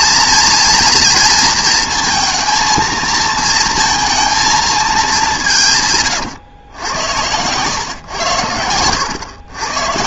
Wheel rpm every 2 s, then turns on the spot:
230, 220, 220, 110, 100.
8-10